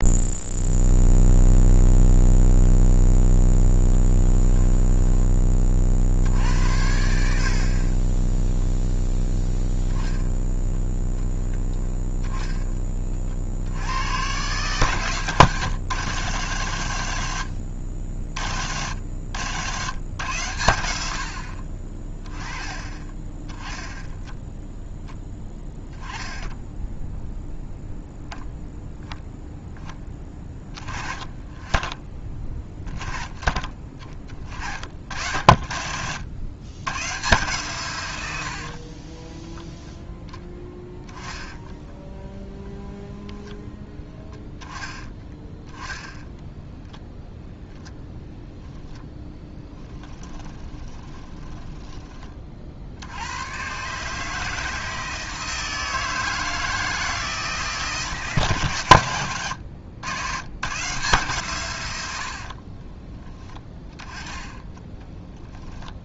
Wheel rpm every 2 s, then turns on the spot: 0, 0, 10, 70, 0, 10, 20, 120, 100, 70, 90, 20, 0, 0, 0, 20, 10, 50, 110, 50, 10, 10, 10, 0, 10, 20, 40, 160, 160, 130, 140, 40, 10.
4-6 38-42 50-52 62-66